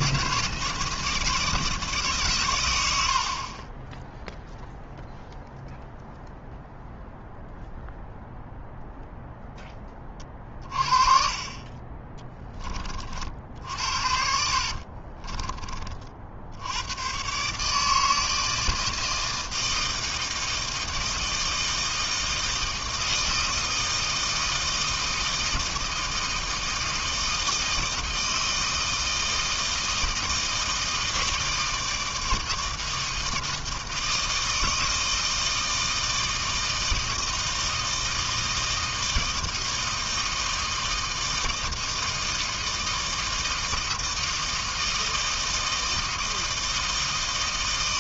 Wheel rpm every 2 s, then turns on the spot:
160, 100, 0, 0, 0, 30, 20, 60, 80, 160, 160, 160, 160, 160, 160, 160, 160, 160, 160, 160, 160, 160, 160, 160.
14-16